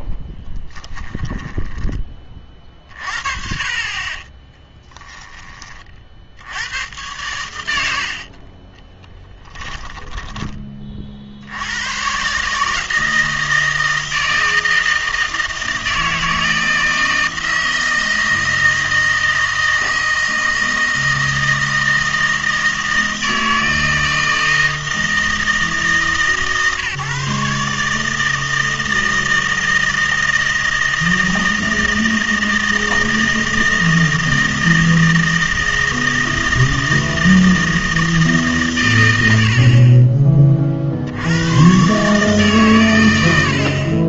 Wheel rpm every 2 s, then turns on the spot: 10, 40, 20, 100, 20, 30, 150, 160, 160, 160, 160, 160, 160, 140, 160, 160, 160, 160, 160, 120, 50, 130.
0-2 4-6 8-10